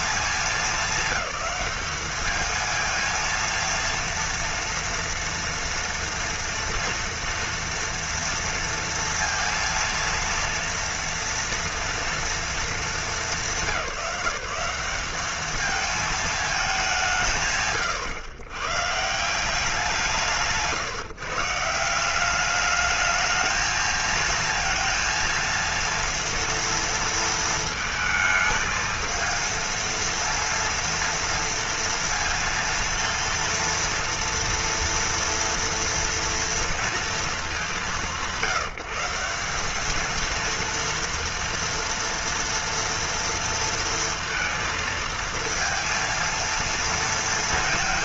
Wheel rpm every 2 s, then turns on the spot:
220, 220, 230, 230, 230, 230, 220, 180, 200, 140, 160, 210, 230, 230, 220, 230, 230, 230, 230, 180, 230, 230, 230, 230.
none